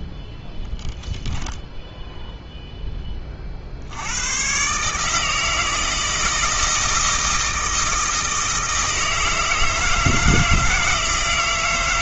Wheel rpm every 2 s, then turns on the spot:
0, 10, 130, 160, 160, 160.
none